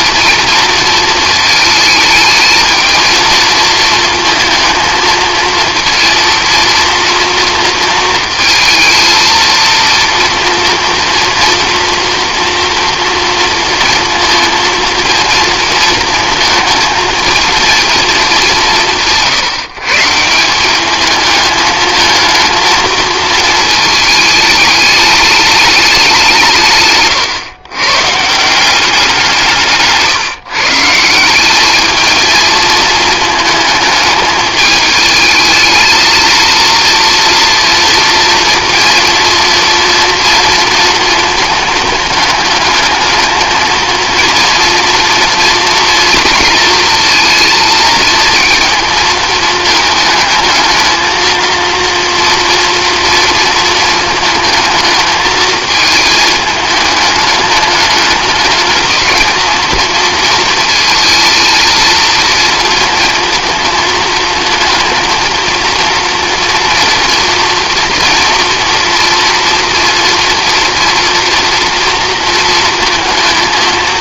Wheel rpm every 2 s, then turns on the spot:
230, 220, 220, 230, 220, 230, 240, 230, 220, 180, 200, 220, 210, 150, 180, 150, 220, 220, 230, 230, 230, 210, 240, 230, 220, 220, 230, 220, 210, 220, 230, 230, 220, 240, 230, 230, 230.
none